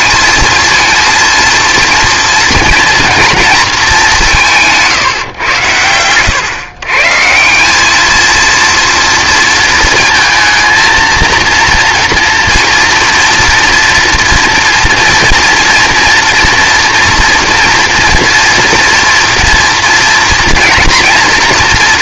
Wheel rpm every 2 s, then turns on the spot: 220, 230, 160, 130, 230, 230, 230, 230, 230, 230, 240.
none